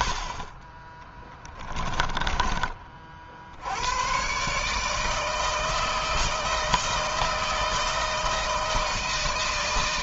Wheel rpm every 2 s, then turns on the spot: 20, 40, 160, 160, 160.
0-2